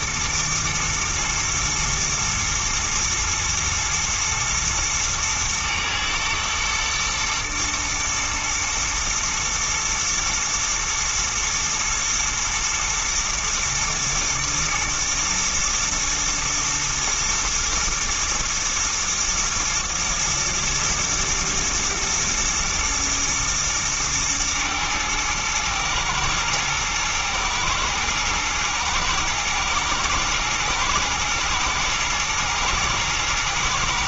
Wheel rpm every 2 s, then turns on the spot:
110, 120, 110, 110, 110, 110, 120, 110, 110, 110, 120, 110, 110, 110, 110, 120, 110.
none